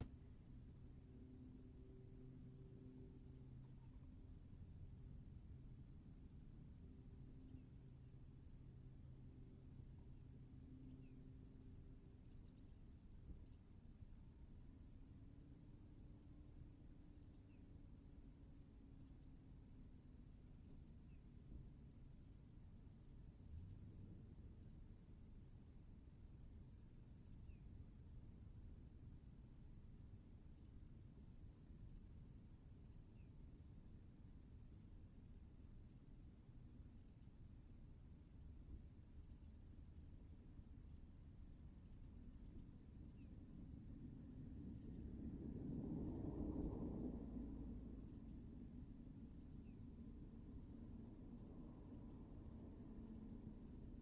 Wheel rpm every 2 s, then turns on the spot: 0, 0, 0, 0, 0, 0, 0, 0, 0, 0, 0, 0, 0, 0, 0, 0, 0, 0, 0, 0, 0, 0, 0, 0, 0, 0, 0.
none